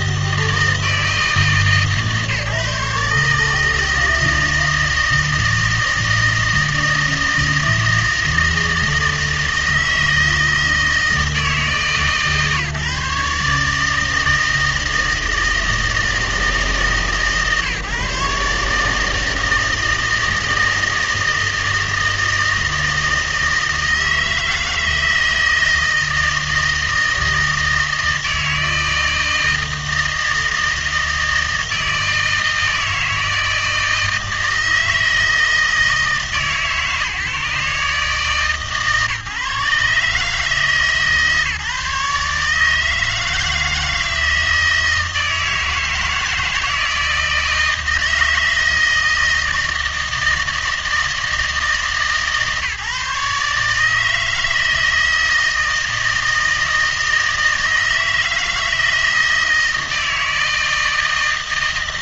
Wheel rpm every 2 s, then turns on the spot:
160, 150, 160, 160, 160, 160, 150, 160, 150, 150, 160, 160, 160, 160, 160, 160, 160, 160, 150, 150, 150, 160, 160, 160, 160, 160, 150, 160, 160, 160, 160.
none